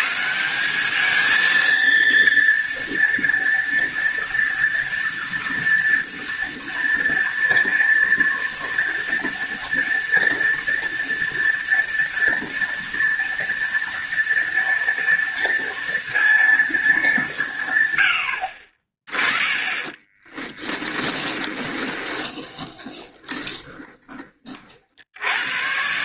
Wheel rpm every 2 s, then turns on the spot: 150, 230, 230, 230, 230, 230, 230, 230, 230, 90, 20, 20, 30.
20-24